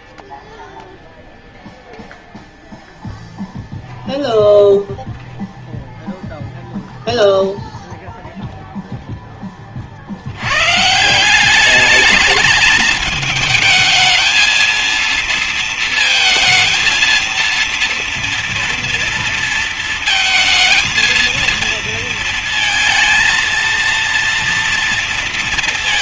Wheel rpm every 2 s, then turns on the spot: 0, 0, 0, 0, 0, 130, 220, 230, 230, 230, 230, 230, 240.
none